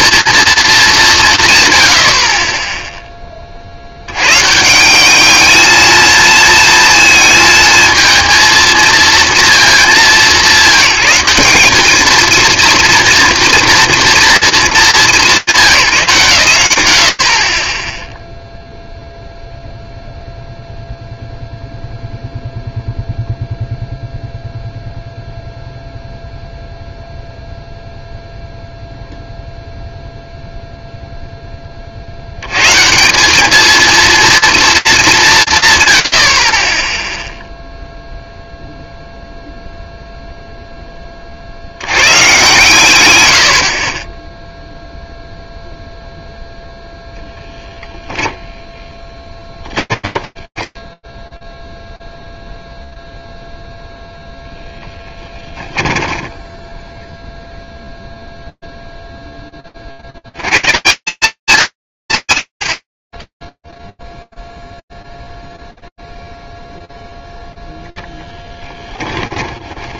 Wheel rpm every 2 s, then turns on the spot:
220, 20, 170, 230, 230, 200, 230, 210, 90, 0, 0, 0, 0, 0, 0, 30, 220, 140, 0, 0, 80, 60, 0, 0, 20, 10, 0, 10, 0, 0, 190, 160, 0, 0, 10.
48-52